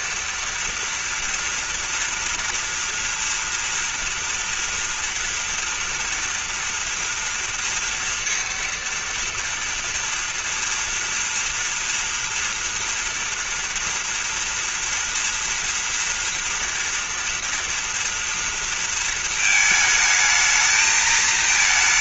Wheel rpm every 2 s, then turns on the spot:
230, 240, 230, 230, 230, 230, 230, 230, 230, 230, 220.
none